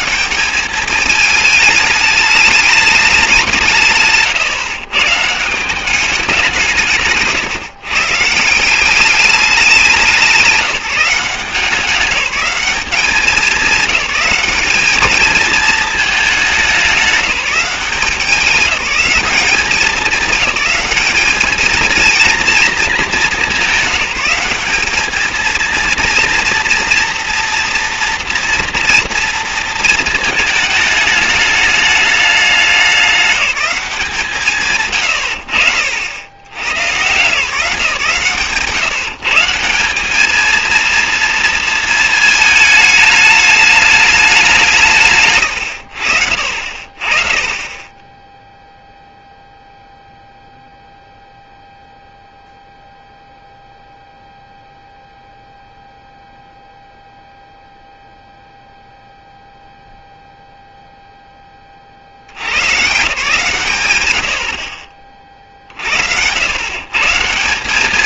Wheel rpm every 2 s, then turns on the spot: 210, 210, 140, 170, 170, 180, 200, 200, 200, 190, 200, 230, 200, 240, 230, 220, 200, 140, 110, 160, 230, 220, 180, 60, 0, 0, 0, 0, 0, 0, 0, 100, 50, 100.
none